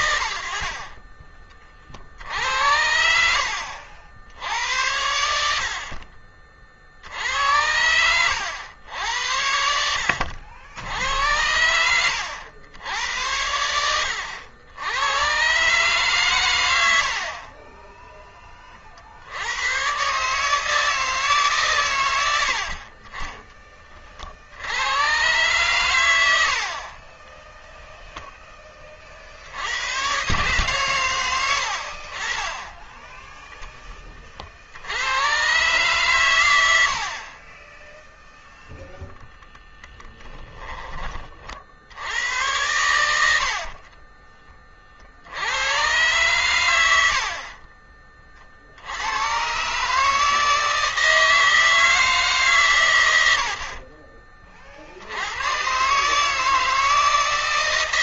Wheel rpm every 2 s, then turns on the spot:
70, 80, 90, 60, 90, 80, 90, 80, 110, 20, 150, 80, 70, 80, 20, 130, 20, 40, 90, 0, 10, 90, 30, 90, 50, 160, 130, 40, 160.
22-24